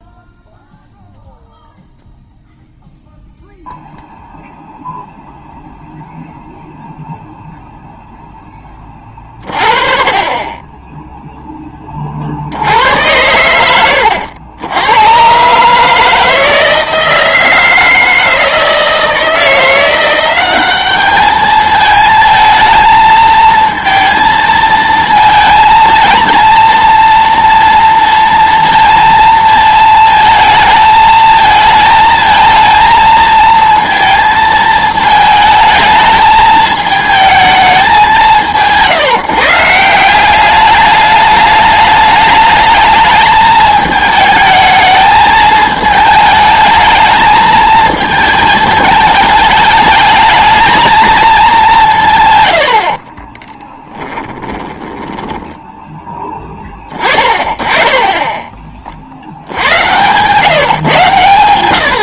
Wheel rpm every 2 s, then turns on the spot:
0, 0, 0, 0, 20, 20, 80, 100, 160, 160, 200, 220, 220, 230, 230, 220, 220, 220, 220, 170, 200, 210, 220, 220, 220, 220, 70, 20, 20, 30, 140.
52-56